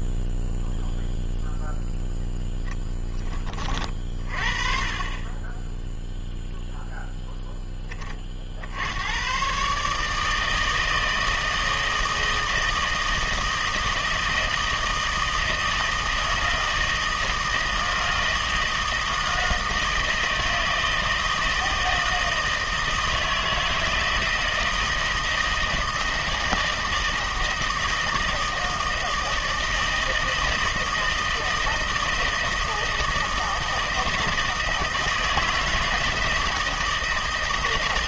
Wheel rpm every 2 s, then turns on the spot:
0, 10, 30, 0, 70, 160, 160, 160, 160, 160, 160, 160, 160, 160, 160, 160, 160, 160, 160.
none